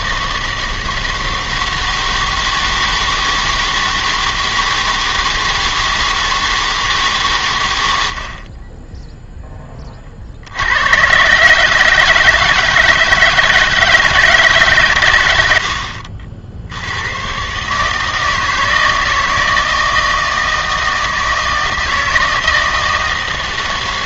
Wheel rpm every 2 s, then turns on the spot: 160, 160, 160, 160, 30, 80, 160, 150, 70, 160, 160, 160.
none